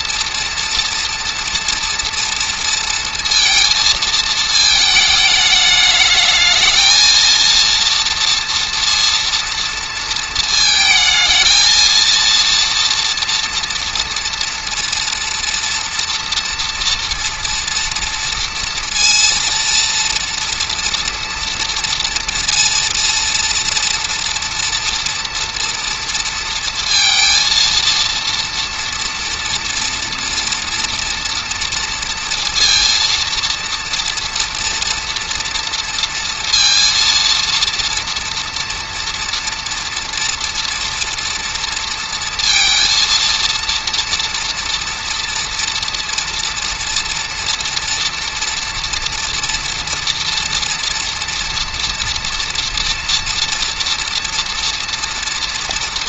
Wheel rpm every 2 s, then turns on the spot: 230, 230, 220, 220, 230, 220, 230, 230, 230, 230, 240, 230, 230, 230, 230, 230, 230, 230, 230, 230, 230, 230, 230, 240, 230, 230, 230, 230.
none